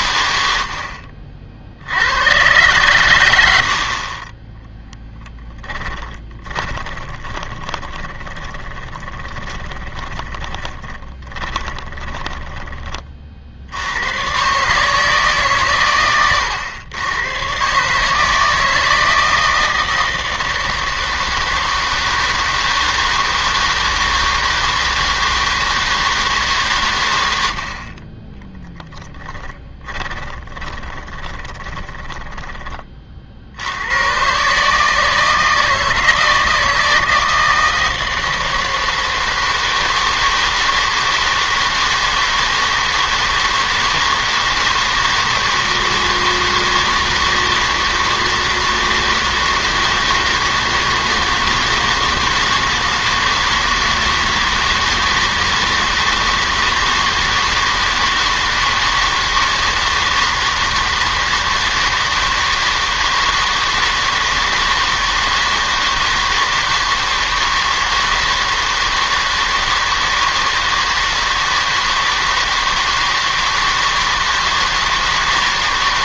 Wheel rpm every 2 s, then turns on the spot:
80, 120, 20, 20, 20, 20, 20, 130, 110, 160, 160, 160, 160, 140, 10, 20, 20, 140, 160, 160, 160, 160, 160, 160, 160, 160, 160, 160, 160, 160, 160, 160, 160, 160, 160, 160, 160, 160.
6-14 30-32